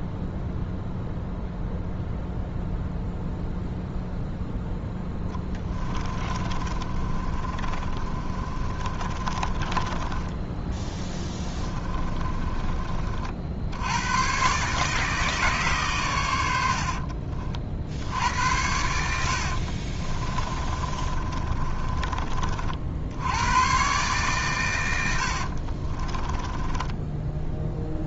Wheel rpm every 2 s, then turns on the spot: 0, 0, 0, 40, 30, 10, 30, 120, 100, 80, 30, 30, 140, 20.
6-14 20-22 26-28